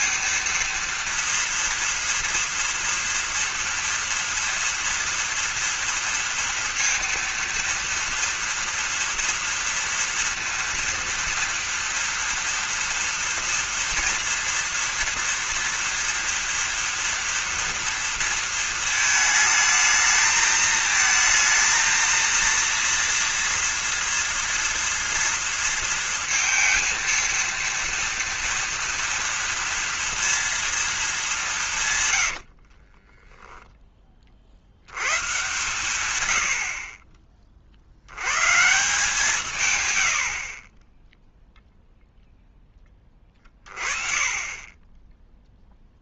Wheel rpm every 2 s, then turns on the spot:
230, 240, 230, 230, 230, 230, 230, 230, 240, 230, 220, 230, 230, 220, 230, 230, 40, 80, 70, 140, 20, 10, 20.
32-34